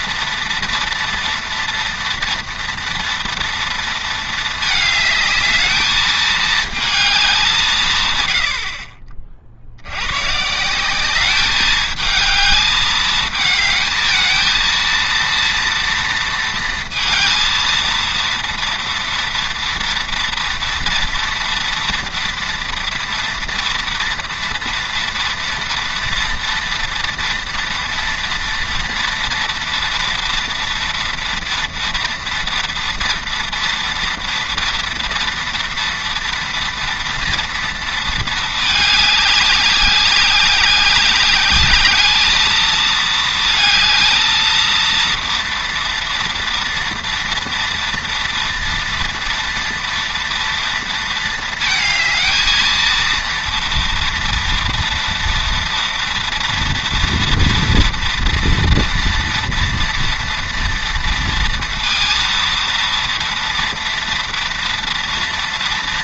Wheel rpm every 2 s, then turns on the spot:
230, 230, 220, 220, 50, 180, 220, 230, 230, 230, 230, 230, 240, 230, 230, 230, 230, 230, 230, 210, 190, 220, 230, 230, 230, 230, 230, 230, 230, 230, 230, 230, 230.
none